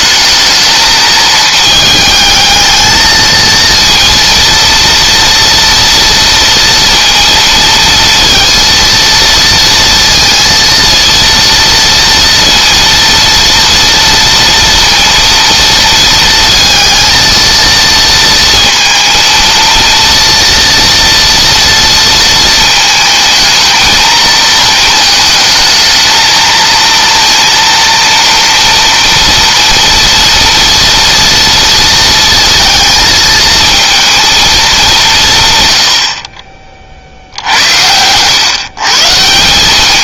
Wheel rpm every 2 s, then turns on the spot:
220, 220, 230, 230, 230, 230, 230, 230, 230, 230, 230, 220, 220, 230, 230, 230, 220, 180, 70, 150.
none